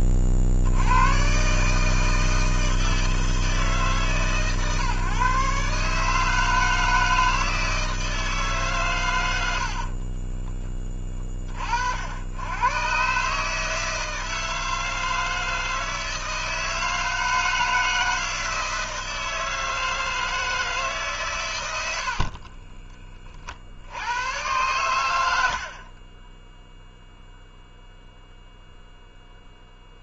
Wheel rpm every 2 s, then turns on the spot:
50, 160, 140, 150, 150, 20, 100, 160, 160, 160, 160, 40, 110, 10, 0.
10-12 22-24